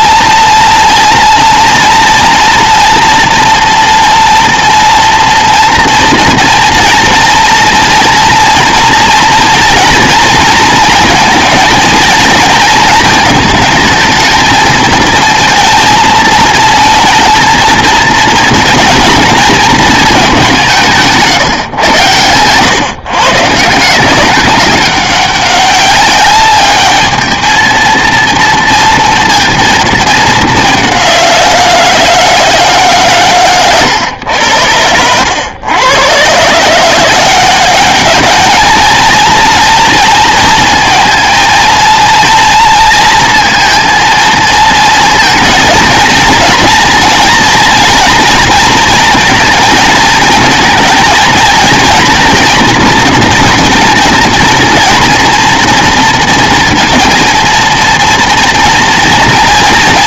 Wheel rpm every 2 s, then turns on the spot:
230, 240, 230, 230, 230, 220, 230, 220, 230, 230, 190, 140, 200, 210, 230, 200, 150, 90, 150, 220, 230, 230, 230, 230, 230, 230, 240, 230, 230, 230.
none